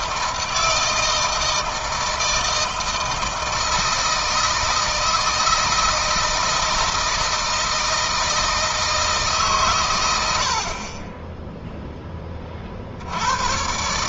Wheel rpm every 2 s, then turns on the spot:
160, 160, 160, 160, 160, 40, 50.
none